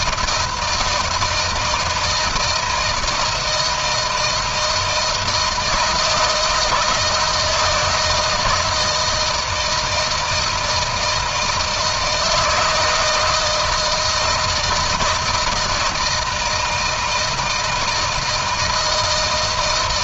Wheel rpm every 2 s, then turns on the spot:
160, 160, 160, 170, 160, 160, 160, 160, 160, 160.
none